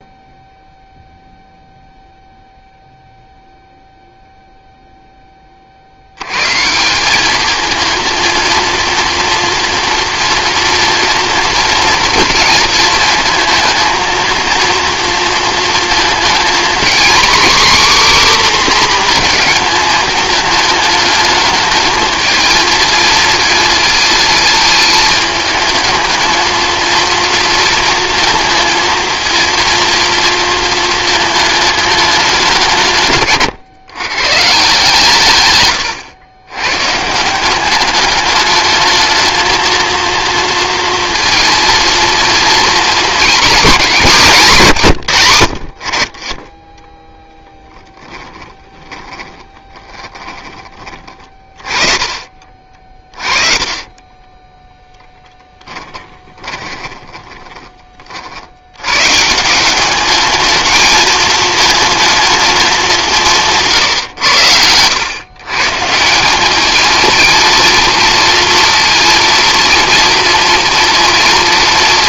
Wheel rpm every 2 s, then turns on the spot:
0, 0, 0, 160, 230, 230, 230, 230, 240, 260, 210, 220, 220, 230, 230, 220, 160, 160, 110, 210, 230, 240, 170, 10, 20, 20, 40, 10, 20, 90, 220, 200, 100, 210, 230, 230.
48-50 52-58